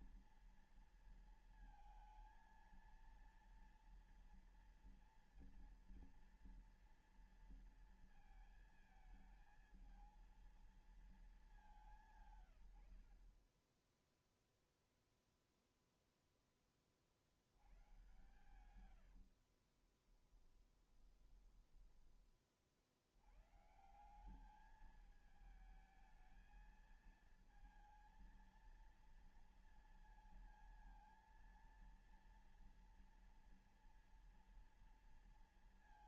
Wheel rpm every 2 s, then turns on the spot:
230, 230, 230, 230, 220, 220, 140, 0, 10, 110, 20, 40, 190, 220, 230, 230, 230, 230.
18-22